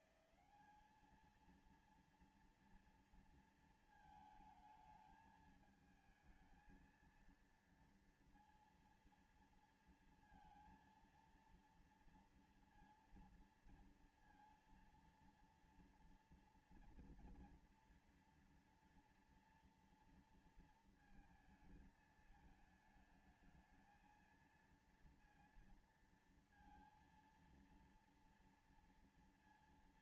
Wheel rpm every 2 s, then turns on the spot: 170, 220, 230, 220, 230, 230, 230, 230, 230, 230, 230, 220, 220, 230, 230.
none